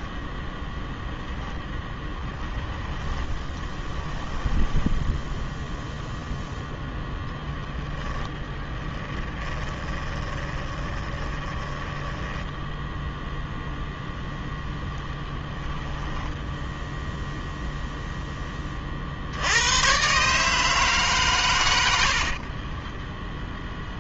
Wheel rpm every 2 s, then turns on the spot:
0, 10, 10, 10, 10, 20, 0, 10, 0, 60, 150, 20.
2-6 8-12 22-24